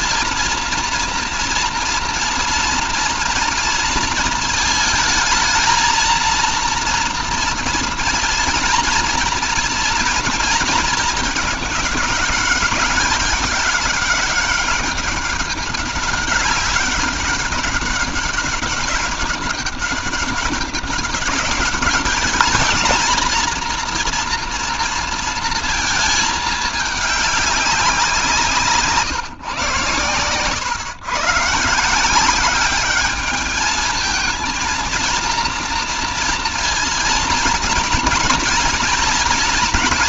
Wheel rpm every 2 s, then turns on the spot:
230, 240, 220, 230, 230, 220, 200, 200, 190, 200, 190, 220, 230, 210, 160, 120, 200, 230, 230, 230.
none